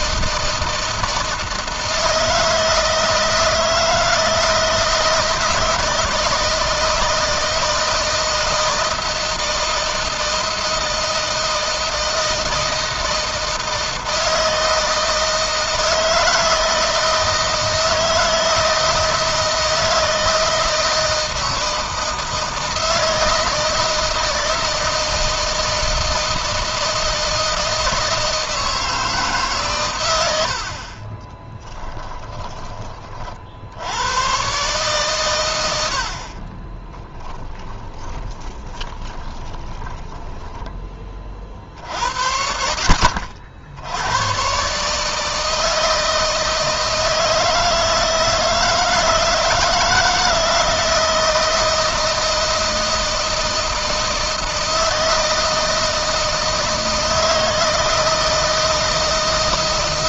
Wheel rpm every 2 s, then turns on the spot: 160, 160, 160, 160, 160, 160, 160, 160, 160, 160, 160, 160, 160, 160, 160, 50, 20, 130, 30, 20, 20, 50, 130, 160, 160, 160, 160, 160, 160, 160.
36-40